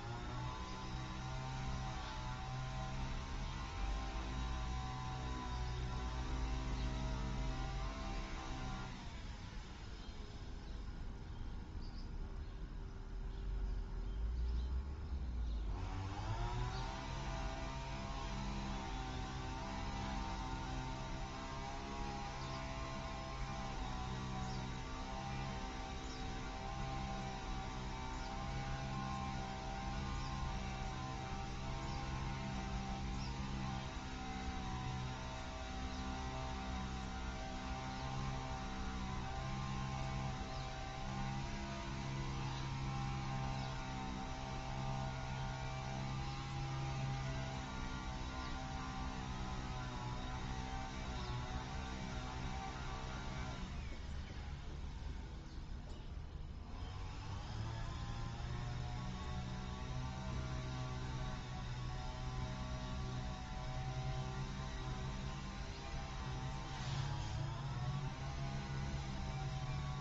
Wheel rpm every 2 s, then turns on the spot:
0, 0, 0, 0, 0, 0, 0, 0, 0, 0, 0, 0, 0, 0, 0, 0, 0, 0, 0, 0, 0, 0, 0, 0, 0, 0, 0, 0, 0, 0, 0, 0, 0, 0, 0.
none